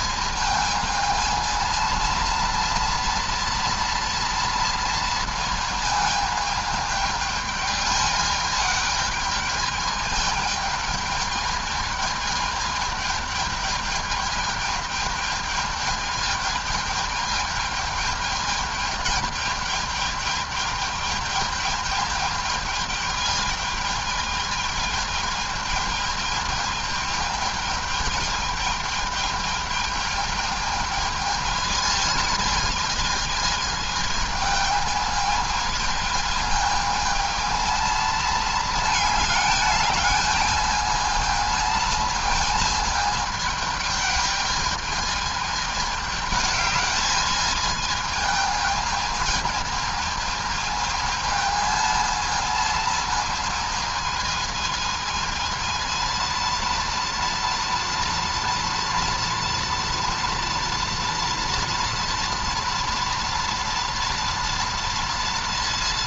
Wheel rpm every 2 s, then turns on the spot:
220, 230, 230, 220, 220, 220, 210, 210, 220, 220, 220, 220, 210, 220, 220, 220, 220, 210, 220, 220, 220, 220, 220, 210, 220, 220, 220, 220, 230, 230, 230, 230, 230.
none